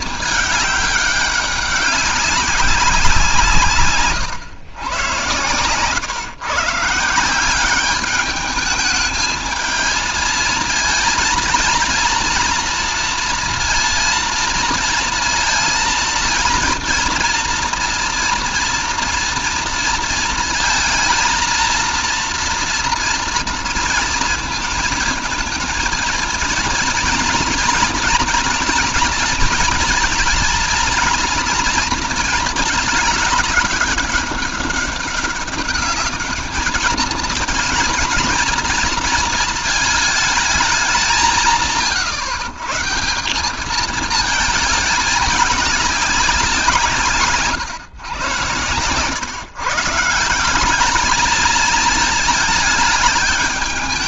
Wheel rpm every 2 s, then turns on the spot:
200, 160, 110, 160, 220, 230, 230, 230, 230, 230, 220, 230, 230, 240, 230, 240, 210, 200, 220, 230, 180, 160, 210, 150, 120, 220, 210.
none